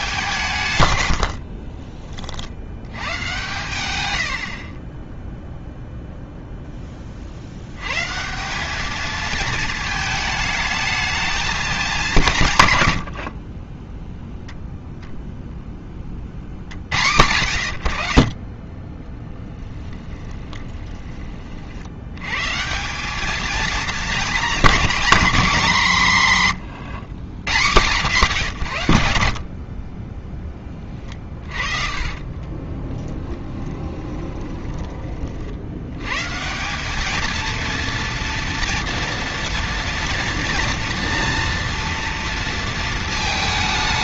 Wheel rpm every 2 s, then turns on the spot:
110, 90, 20, 10, 210, 220, 120, 0, 80, 20, 30, 180, 230, 120, 100, 20, 30, 40, 190, 230, 230, 210.
0-2 12-14 20-22 26-28 30-36